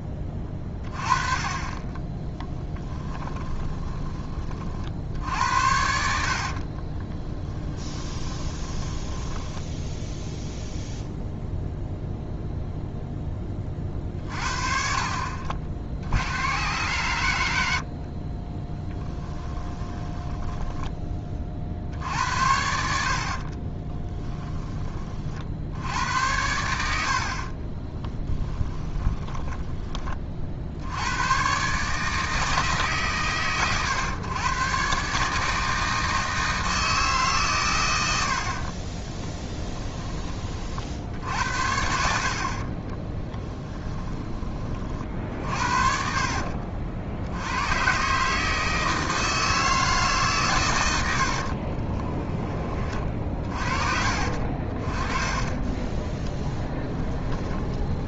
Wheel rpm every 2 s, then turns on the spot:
20, 10, 50, 40, 20, 0, 0, 50, 100, 20, 10, 70, 20, 80, 10, 70, 150, 130, 160, 40, 50, 30, 50, 60, 160, 110, 30, 40, 10.
2-4 6-10 18-20 26-30 38-40 42-44 52-54 56-58